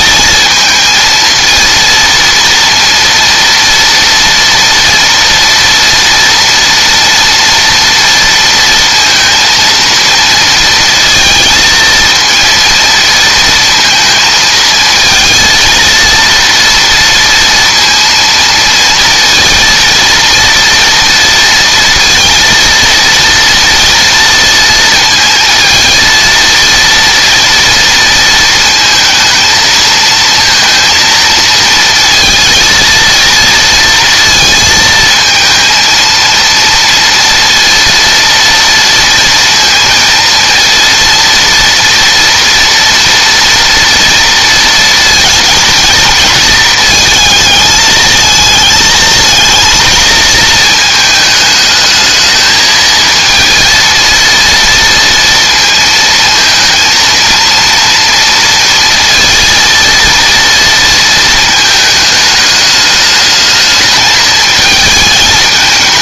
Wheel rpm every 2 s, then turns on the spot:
230, 230, 230, 230, 230, 230, 230, 230, 230, 230, 230, 230, 230, 230, 220, 230, 230, 220, 230, 230, 230, 230, 230, 220, 220, 220, 220, 230, 230, 230, 230, 210, 220.
none